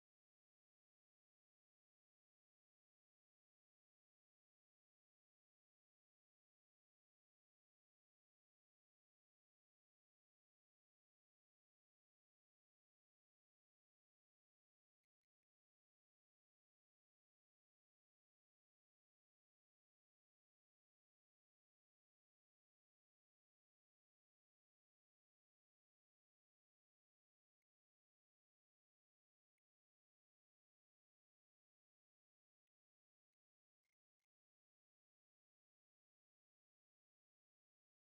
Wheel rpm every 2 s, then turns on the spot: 0, 0, 0, 0, 0, 0, 0, 0, 0, 0, 0, 0, 0, 0, 0, 0, 0, 0, 0.
none